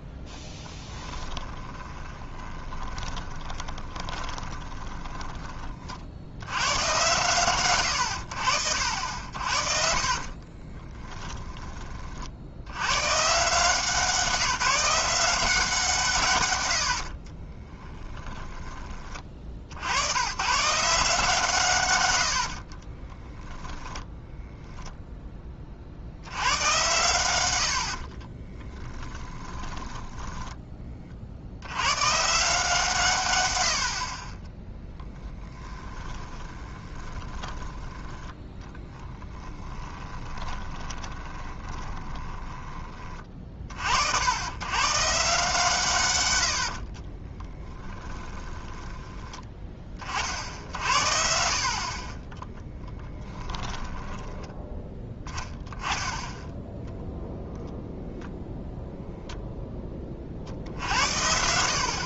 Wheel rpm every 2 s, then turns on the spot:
10, 20, 20, 110, 70, 30, 70, 180, 100, 20, 140, 40, 0, 100, 20, 20, 160, 20, 20, 20, 20, 20, 120, 80, 20, 60, 10, 10, 0, 0, 60.
0-6 10-12 22-24 28-30 36-38 40-42 46-50 52-54